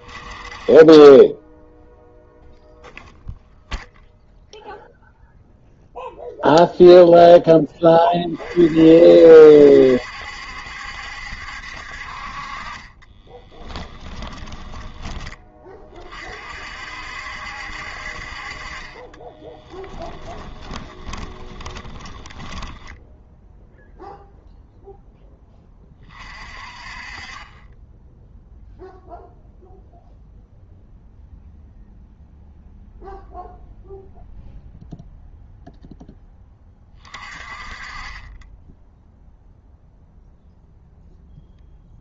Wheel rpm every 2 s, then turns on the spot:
10, 0, 0, 0, 50, 70, 30, 10, 60, 30, 20, 10, 0, 40, 0, 0, 0, 0, 30, 10, 0.
12-16 20-22